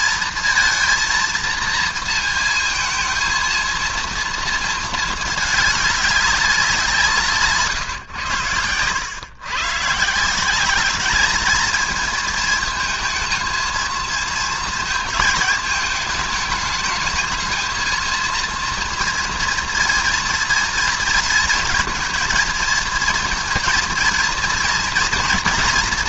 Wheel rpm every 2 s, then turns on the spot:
220, 230, 230, 190, 100, 180, 220, 230, 210, 230, 230, 220, 230.
none